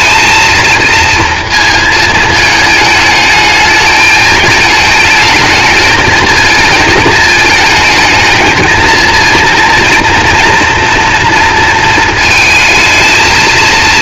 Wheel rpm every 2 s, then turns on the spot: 230, 210, 220, 220, 220, 230, 220.
none